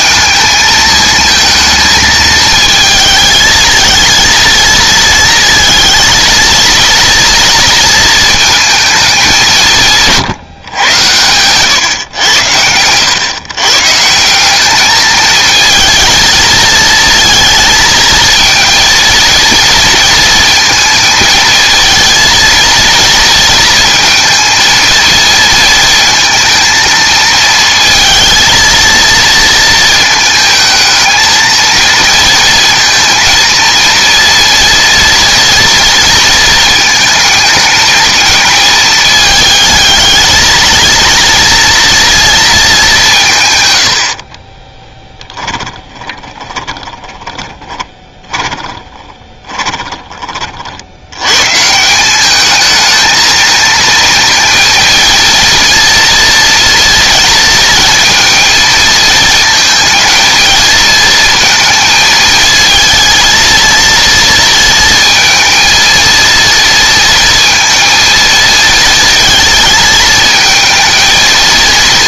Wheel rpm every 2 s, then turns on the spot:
220, 220, 230, 230, 220, 130, 100, 200, 220, 230, 230, 220, 230, 220, 230, 220, 230, 230, 230, 220, 220, 210, 20, 20, 20, 50, 210, 230, 240, 230, 230, 220, 230, 230, 230, 230.
44-50